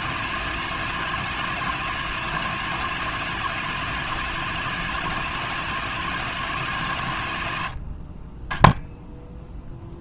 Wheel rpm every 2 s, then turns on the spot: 160, 160, 160, 130, 10.
none